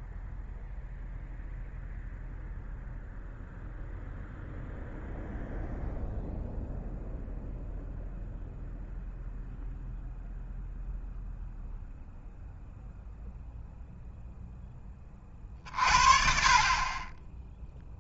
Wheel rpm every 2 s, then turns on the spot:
0, 0, 0, 0, 0, 0, 0, 0, 40.
none